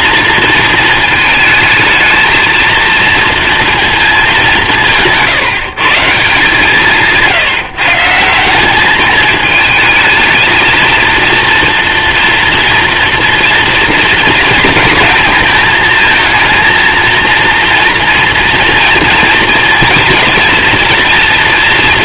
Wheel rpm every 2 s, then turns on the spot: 230, 230, 180, 160, 190, 230, 230, 230, 220, 230, 240.
none